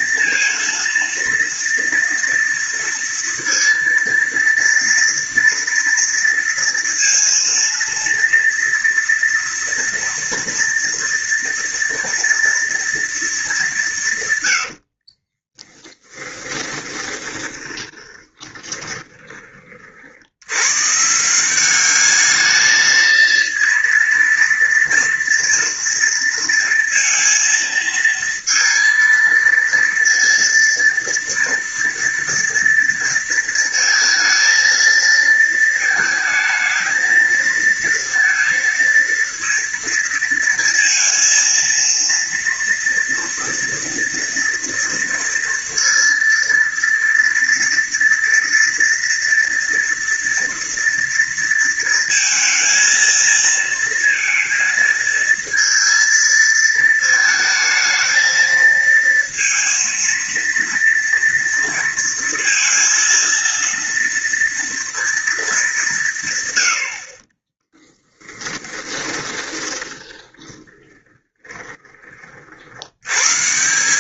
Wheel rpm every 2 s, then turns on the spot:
230, 230, 230, 230, 230, 230, 230, 120, 20, 10, 100, 220, 230, 230, 230, 230, 230, 230, 220, 230, 230, 230, 230, 230, 230, 230, 230, 230, 220, 230, 230, 230, 230, 110, 20, 20, 50.
14-20 68-72